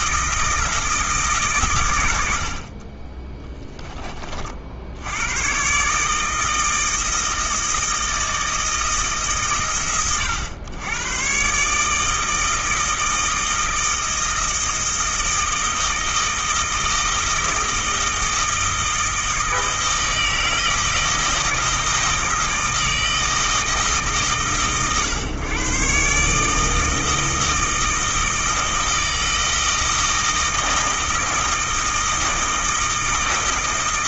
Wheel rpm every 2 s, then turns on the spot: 160, 40, 60, 160, 160, 100, 160, 160, 160, 160, 160, 160, 130, 160, 160, 160, 160.
2-4